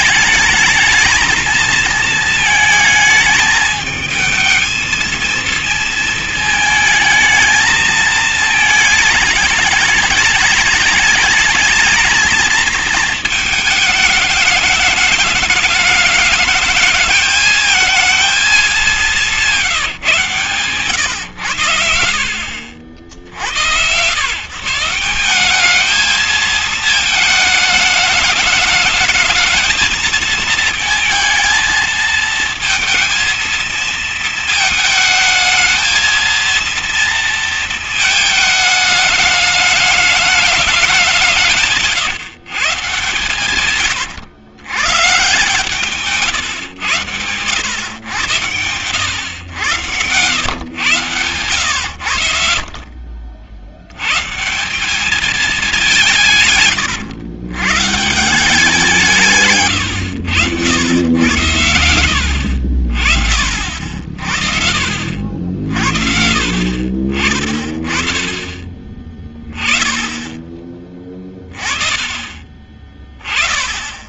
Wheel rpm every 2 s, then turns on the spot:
220, 220, 220, 220, 220, 210, 220, 210, 220, 210, 120, 50, 130, 220, 220, 220, 230, 220, 230, 220, 210, 140, 130, 120, 100, 100, 60, 150, 140, 170, 100, 70, 60, 60, 30, 20, 20.
56-58